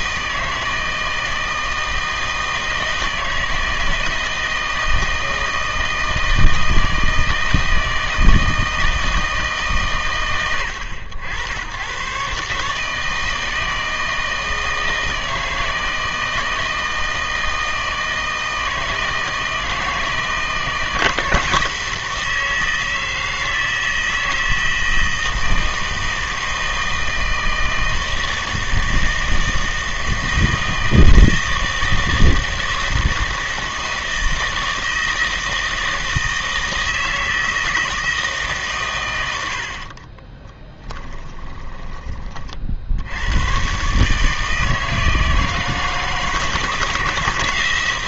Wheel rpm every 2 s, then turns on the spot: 160, 160, 160, 160, 160, 90, 150, 160, 160, 160, 160, 160, 160, 160, 160, 160, 160, 160, 160, 140, 10, 50, 160, 160.
40-42